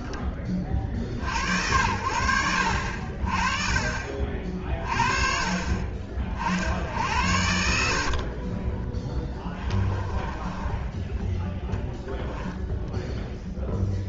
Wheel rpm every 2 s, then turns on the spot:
40, 60, 30, 70, 20, 10, 10.
8-10